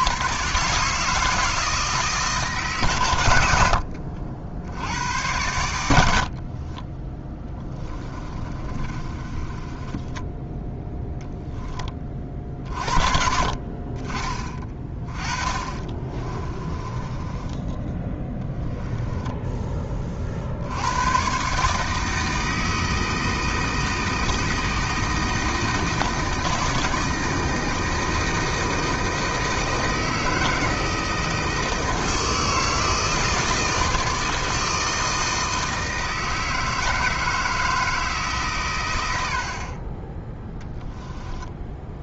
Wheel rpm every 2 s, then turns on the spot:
140, 130, 90, 30, 30, 10, 50, 20, 20, 10, 90, 160, 160, 160, 160, 160, 160, 160, 160, 110, 10.
6-10 16-20 40-42